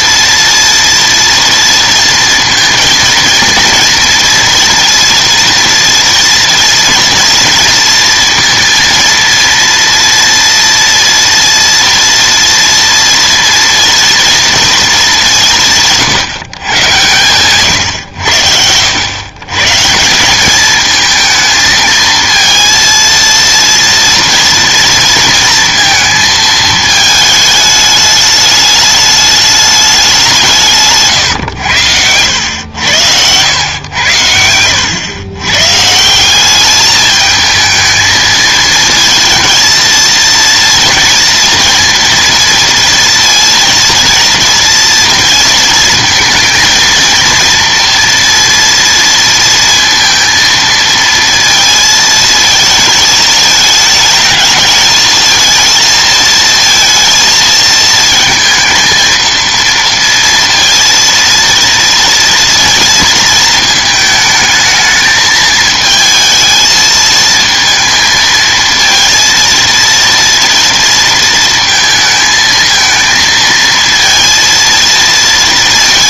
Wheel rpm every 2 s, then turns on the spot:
230, 230, 230, 230, 230, 230, 230, 230, 120, 90, 200, 230, 230, 220, 210, 160, 90, 90, 200, 220, 230, 230, 230, 220, 230, 230, 220, 220, 230, 230, 230, 230, 220, 220, 230, 230, 220, 220.
none